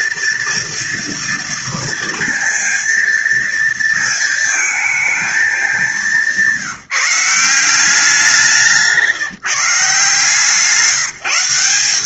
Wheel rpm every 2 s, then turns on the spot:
230, 230, 220, 180, 160, 170.
none